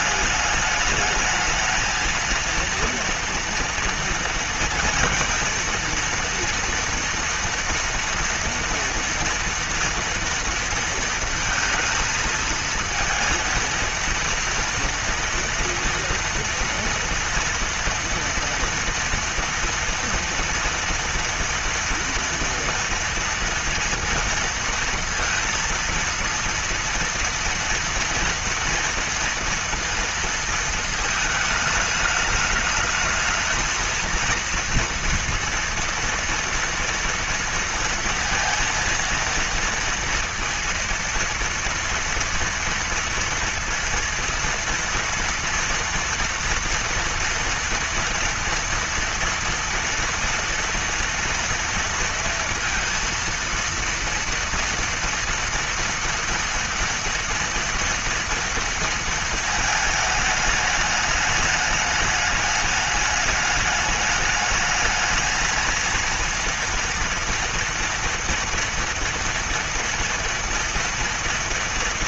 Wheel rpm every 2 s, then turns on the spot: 210, 230, 230, 230, 230, 230, 230, 230, 240, 230, 230, 230, 230, 230, 230, 230, 210, 230, 230, 230, 230, 230, 230, 230, 230, 230, 230, 230, 230, 230, 210, 210, 210, 230, 230, 230.
none